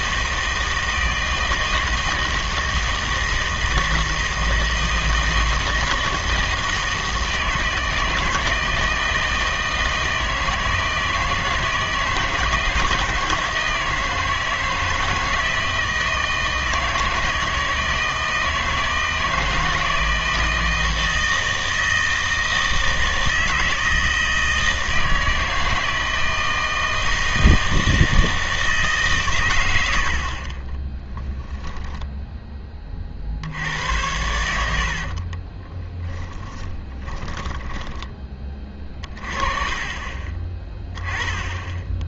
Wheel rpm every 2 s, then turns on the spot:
160, 160, 160, 160, 160, 160, 160, 160, 160, 160, 160, 160, 160, 160, 160, 20, 20, 80, 20, 30, 20.
34-38